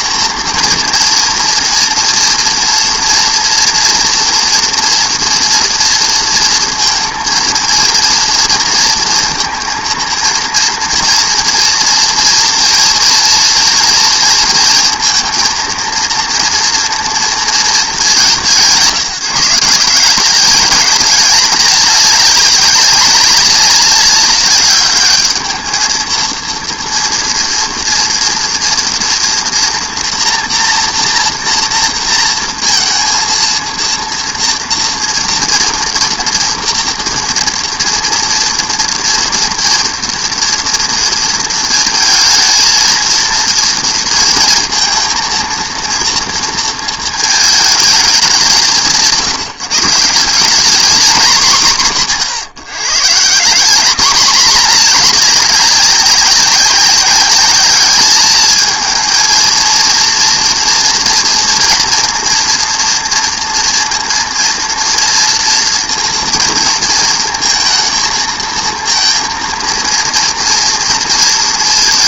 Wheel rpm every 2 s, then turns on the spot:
230, 230, 230, 230, 230, 230, 230, 230, 230, 170, 210, 200, 200, 230, 230, 240, 230, 230, 230, 230, 230, 230, 230, 230, 180, 200, 140, 210, 190, 210, 230, 230, 230, 230, 230, 230.
none